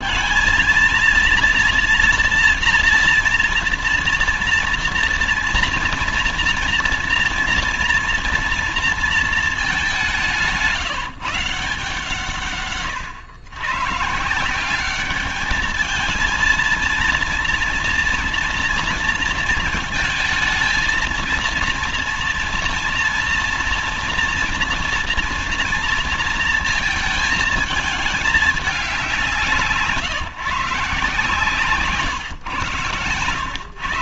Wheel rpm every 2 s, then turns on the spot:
230, 230, 240, 240, 240, 180, 140, 180, 230, 230, 230, 230, 230, 230, 200, 150, 130.
none